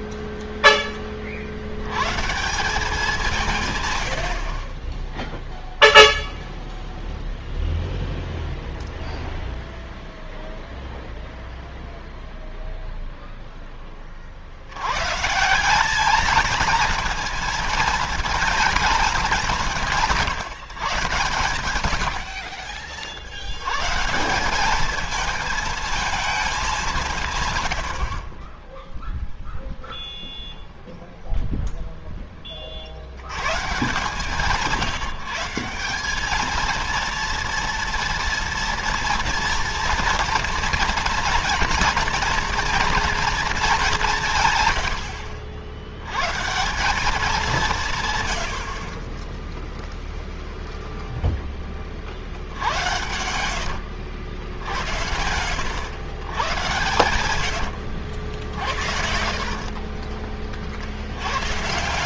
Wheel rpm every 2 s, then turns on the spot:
20, 180, 20, 0, 0, 0, 0, 100, 220, 220, 120, 60, 210, 180, 10, 0, 60, 160, 220, 230, 230, 230, 110, 180, 40, 0, 90, 80, 110, 70, 70.
44-46 56-60